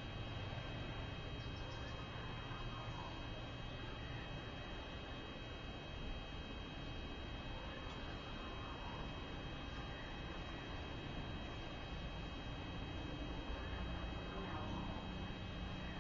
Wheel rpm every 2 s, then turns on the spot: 0, 0, 0, 0, 0, 0, 0, 0.
none